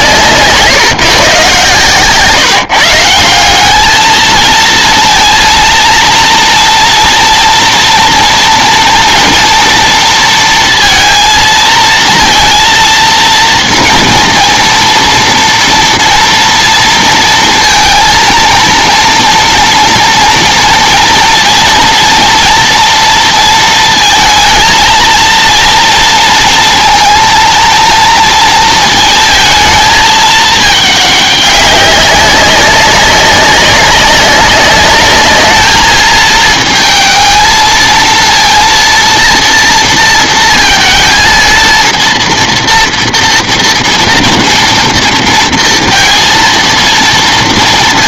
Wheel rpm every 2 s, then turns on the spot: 150, 160, 220, 230, 230, 230, 230, 230, 230, 230, 230, 230, 220, 230, 230, 210, 190, 200, 220, 230, 230, 230, 230, 230.
none